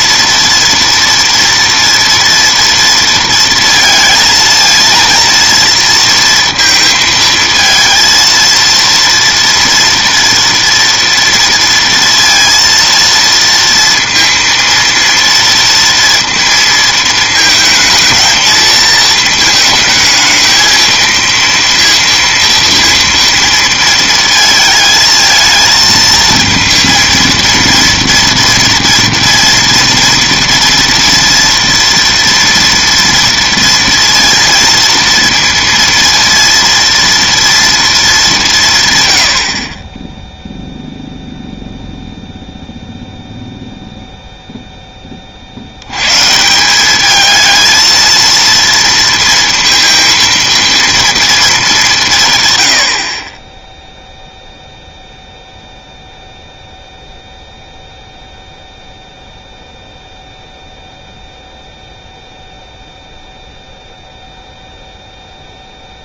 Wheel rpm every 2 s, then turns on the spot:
230, 230, 230, 230, 230, 230, 230, 230, 230, 220, 220, 230, 220, 230, 230, 230, 230, 230, 230, 170, 0, 0, 0, 190, 230, 230, 90, 0, 0, 0, 0, 0, 0.
none